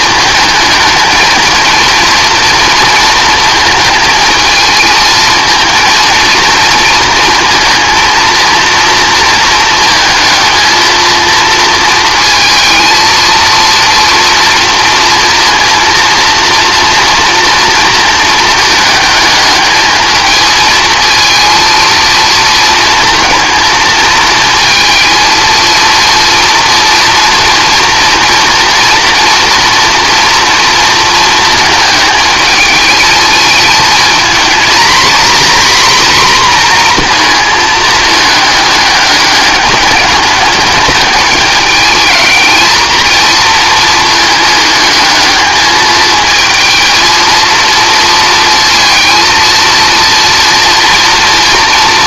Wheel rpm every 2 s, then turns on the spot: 220, 230, 220, 230, 230, 230, 230, 230, 230, 220, 220, 230, 230, 230, 240, 230, 220, 240, 240, 210, 210, 220, 220, 230, 230, 230.
none